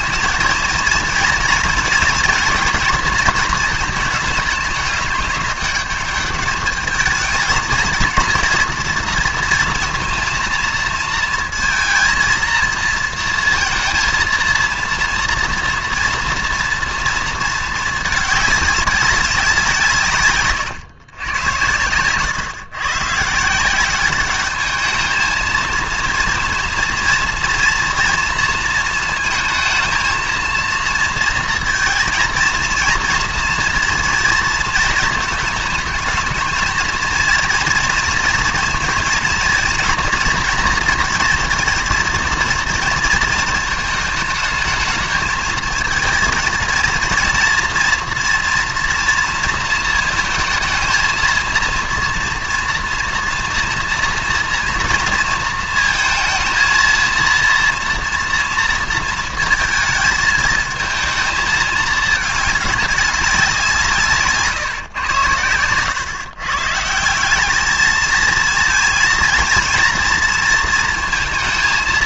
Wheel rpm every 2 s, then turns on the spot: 230, 230, 210, 210, 230, 230, 230, 230, 240, 200, 120, 130, 210, 230, 230, 230, 230, 230, 230, 230, 230, 230, 220, 230, 230, 220, 230, 230, 230, 230, 220, 210, 130, 150, 230, 230.
none